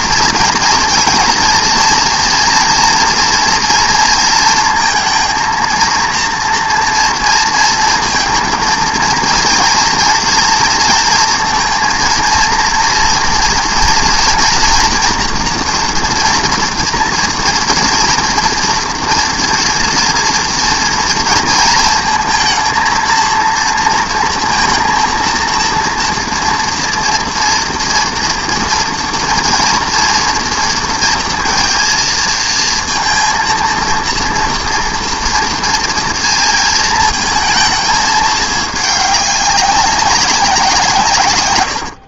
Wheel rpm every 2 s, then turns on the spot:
230, 230, 220, 230, 230, 230, 230, 230, 230, 230, 230, 230, 230, 230, 230, 230, 230, 240, 230, 210, 170.
none